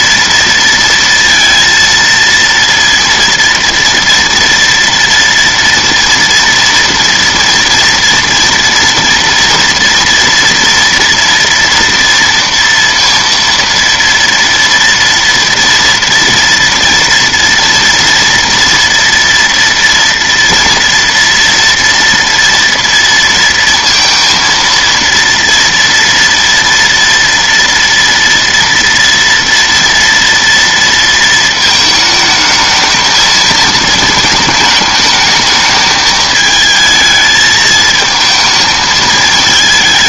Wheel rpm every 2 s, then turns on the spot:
230, 230, 230, 230, 230, 230, 230, 230, 230, 230, 230, 230, 230, 230, 230, 230, 220, 220, 220, 220.
none